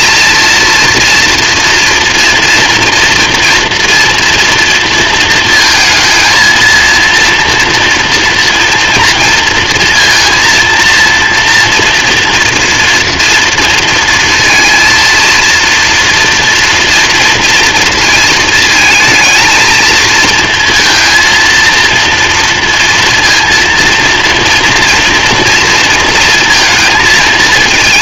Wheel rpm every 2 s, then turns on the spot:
230, 230, 230, 240, 230, 230, 230, 230, 230, 220, 230, 230, 230, 220.
none